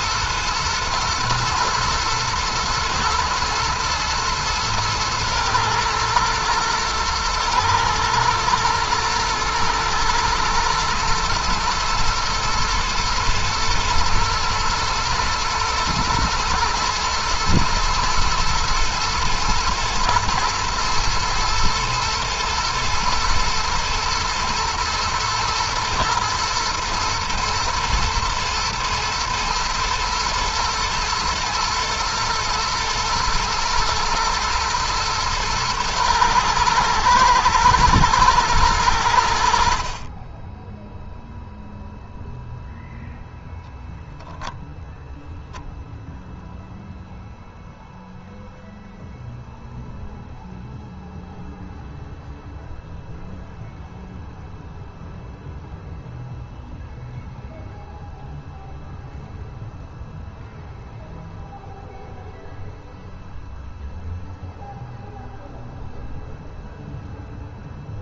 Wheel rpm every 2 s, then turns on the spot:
120, 120, 120, 120, 120, 120, 120, 120, 120, 110, 120, 120, 120, 110, 110, 110, 110, 110, 110, 90, 0, 0, 0, 0, 0, 0, 0, 0, 0, 0, 0, 0, 0, 0.
none